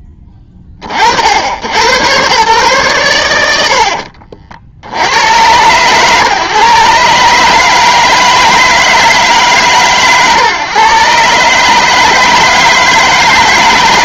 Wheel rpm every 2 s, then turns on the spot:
20, 130, 50, 140, 160, 130, 160.
none